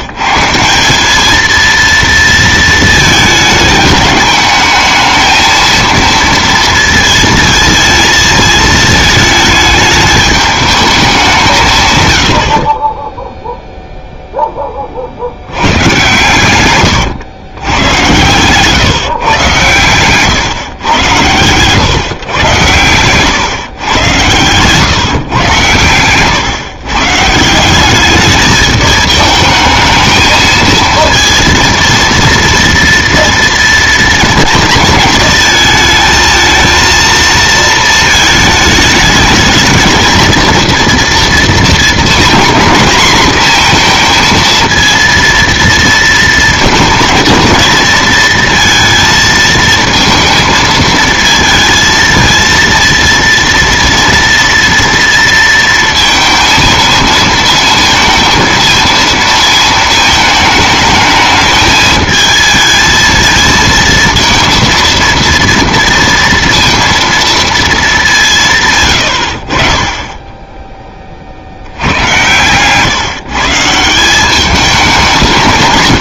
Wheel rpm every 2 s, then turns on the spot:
190, 220, 220, 230, 220, 210, 30, 30, 120, 140, 110, 120, 140, 140, 220, 230, 230, 230, 230, 210, 230, 230, 230, 230, 230, 220, 230, 230, 230, 220, 210, 220, 230, 230, 140, 10, 140, 190.
16-18